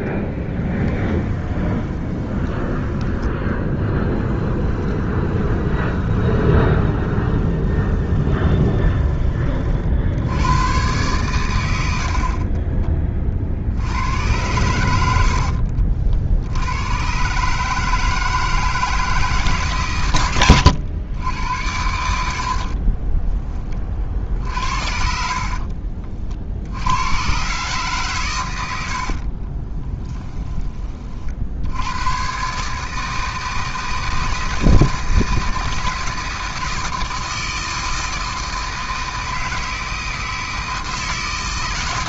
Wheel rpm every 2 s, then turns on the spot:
10, 10, 10, 20, 20, 110, 30, 100, 90, 160, 100, 50, 60, 80, 110, 20, 150, 160, 160, 160, 160.
0-2 4-10 12-14 22-24